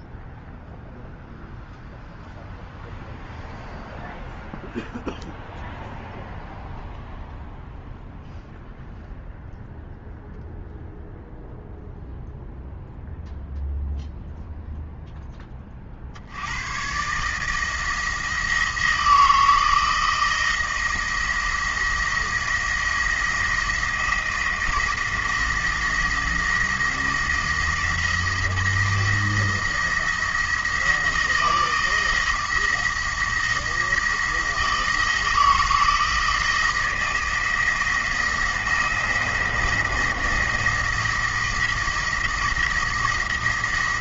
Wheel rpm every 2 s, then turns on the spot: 0, 0, 0, 0, 0, 0, 0, 0, 110, 160, 170, 170, 170, 170, 170, 170, 170, 160, 160, 170, 170, 170.
none